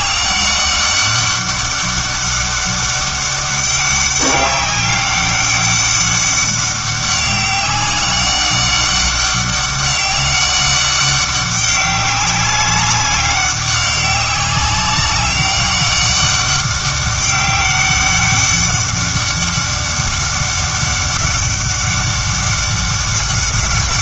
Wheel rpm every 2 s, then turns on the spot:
200, 200, 200, 200, 200, 200, 200, 190, 200, 200, 200, 190.
none